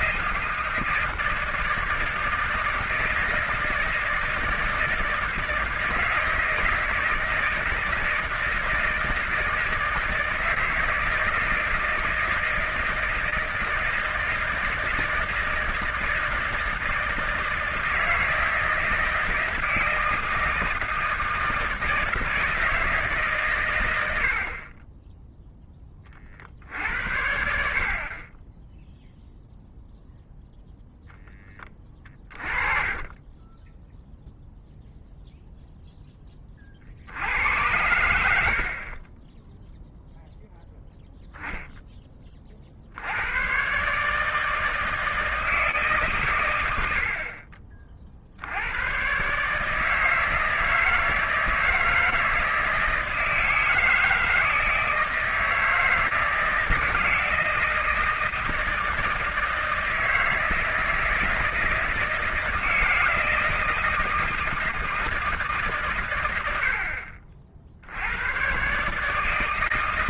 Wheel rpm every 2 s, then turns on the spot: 160, 160, 160, 160, 160, 160, 160, 160, 160, 160, 160, 160, 50, 50, 20, 0, 30, 0, 20, 70, 0, 40, 160, 130, 60, 160, 160, 160, 160, 160, 160, 160, 160, 80, 110.
32-34